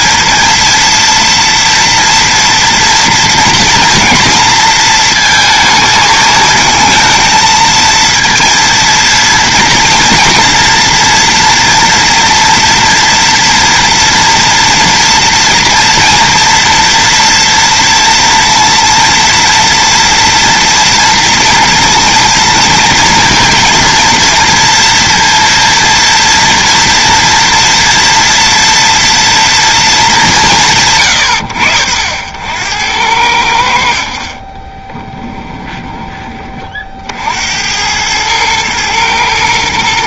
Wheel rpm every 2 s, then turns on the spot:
220, 230, 230, 220, 230, 230, 230, 240, 240, 230, 230, 230, 230, 230, 230, 160, 80, 30, 30, 110.
34-36